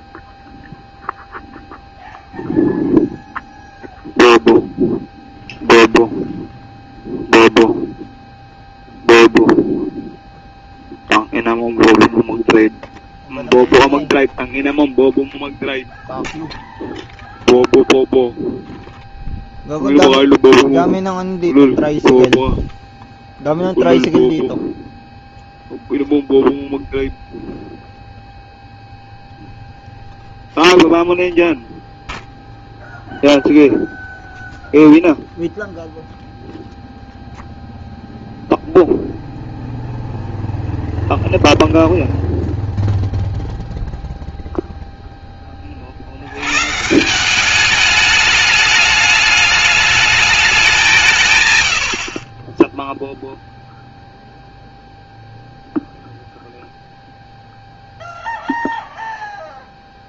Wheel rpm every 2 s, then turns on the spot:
0, 0, 0, 0, 0, 0, 0, 0, 0, 0, 0, 0, 0, 0, 0, 0, 0, 0, 0, 0, 0, 0, 0, 130, 210, 200, 10, 0, 0, 0.
none